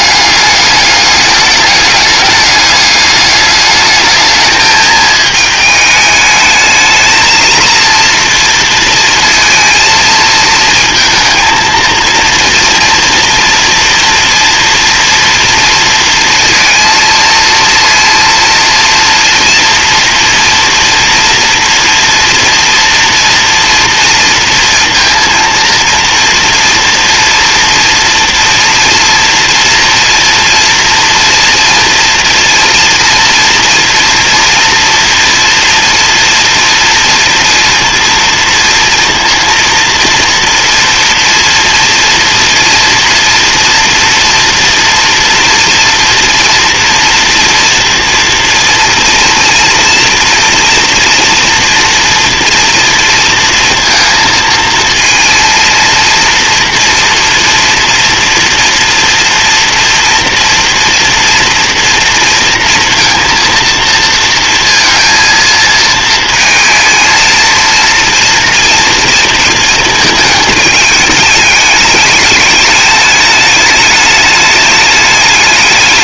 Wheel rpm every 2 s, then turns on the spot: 200, 210, 220, 220, 230, 230, 230, 240, 230, 230, 230, 240, 230, 230, 230, 230, 230, 230, 230, 230, 240, 240, 230, 230, 230, 230, 230, 230, 230, 230, 230, 230, 230, 230, 230, 210, 210, 210.
none